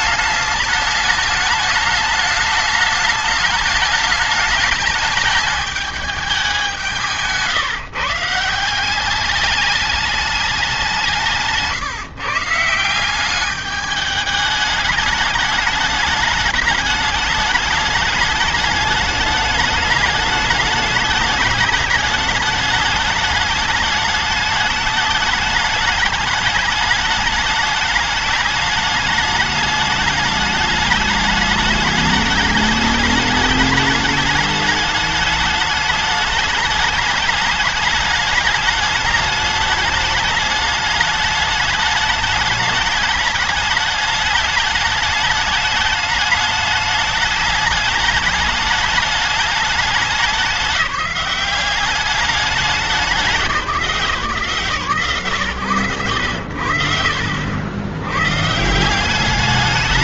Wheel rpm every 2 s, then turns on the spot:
210, 210, 210, 170, 210, 150, 210, 210, 210, 210, 210, 210, 210, 210, 210, 210, 210, 210, 210, 210, 210, 210, 210, 210, 200, 190, 170, 110, 80, 190.
none